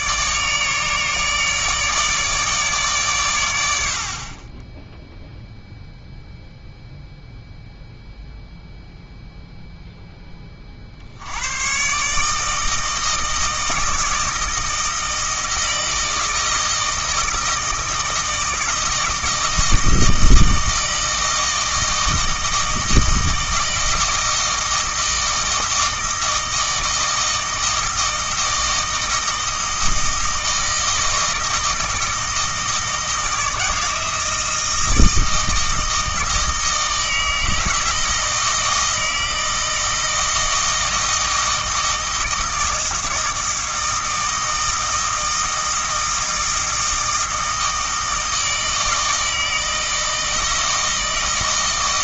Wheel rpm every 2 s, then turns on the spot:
150, 140, 10, 0, 0, 40, 160, 160, 160, 160, 160, 160, 160, 160, 160, 160, 160, 160, 160, 160, 160, 160, 160, 160, 160, 160.
none